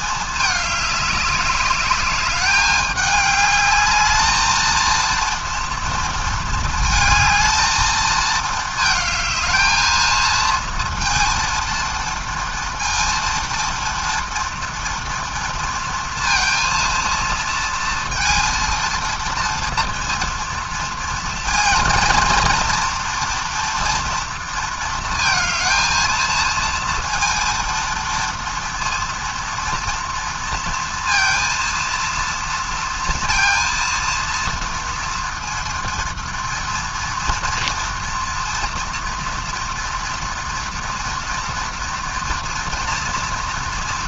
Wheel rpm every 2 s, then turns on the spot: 210, 210, 220, 220, 220, 230, 230, 230, 230, 230, 230, 230, 230, 230, 230, 230, 230, 230, 230, 240, 230, 240.
none